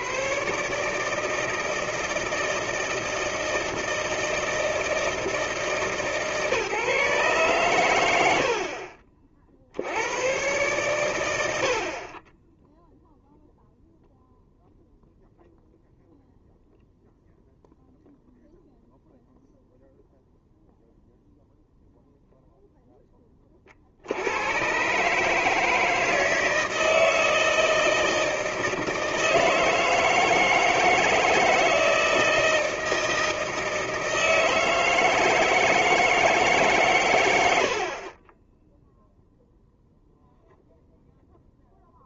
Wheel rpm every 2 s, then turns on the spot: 140, 160, 160, 150, 50, 120, 0, 0, 0, 0, 0, 0, 120, 160, 160, 160, 160, 160, 140, 0, 0.
none